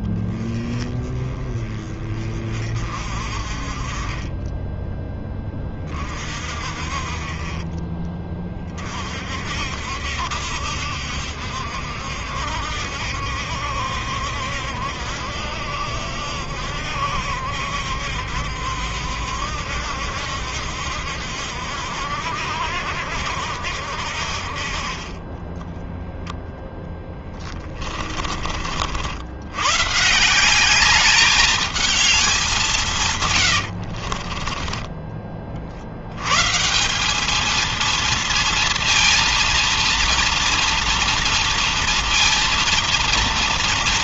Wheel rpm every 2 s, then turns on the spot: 10, 40, 20, 40, 30, 70, 70, 70, 60, 70, 70, 70, 60, 10, 40, 170, 200, 40, 120, 230, 230, 230.
34-36